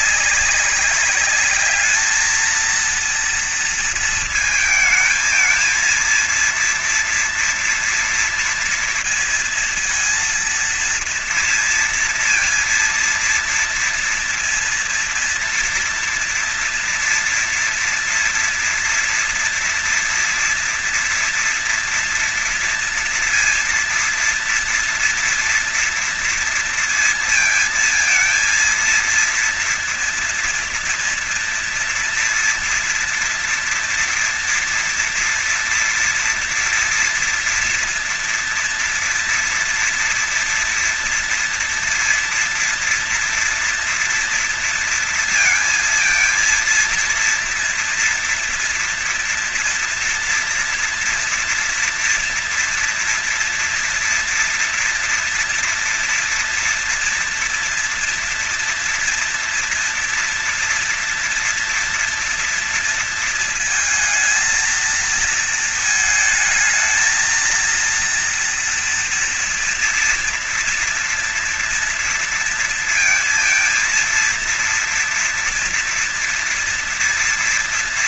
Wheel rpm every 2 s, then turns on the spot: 200, 220, 230, 230, 230, 230, 230, 230, 240, 230, 230, 230, 240, 230, 230, 230, 230, 230, 230, 230, 230, 230, 230, 230, 240, 230, 230, 240, 230, 240, 230, 230, 220, 220, 230, 240, 230, 230, 230.
none